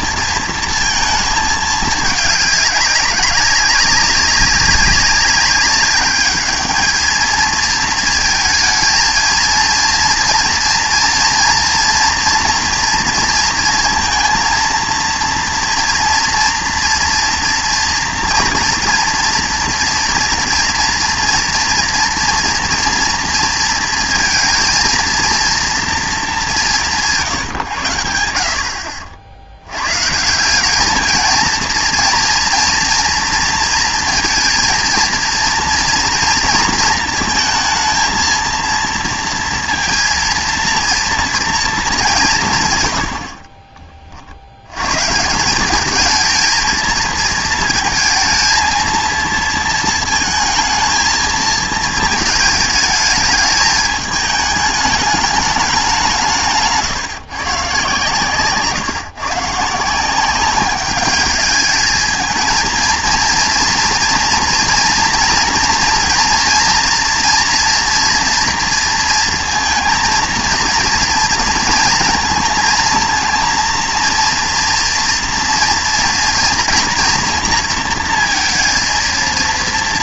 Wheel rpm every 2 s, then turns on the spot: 230, 200, 200, 210, 220, 230, 230, 230, 230, 230, 230, 230, 230, 200, 70, 190, 230, 230, 230, 230, 230, 170, 90, 230, 230, 220, 220, 210, 160, 130, 190, 220, 230, 240, 230, 230, 220, 230, 240, 230.
none